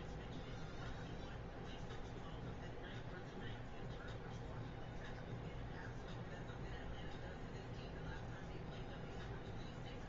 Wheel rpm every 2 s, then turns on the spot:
0, 0, 0, 0, 0.
none